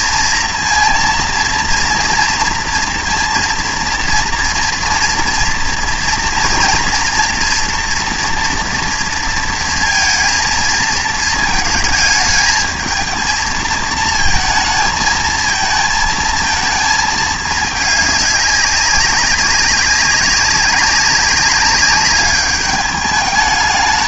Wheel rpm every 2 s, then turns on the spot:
230, 230, 230, 240, 230, 230, 220, 220, 230, 200, 190, 210.
none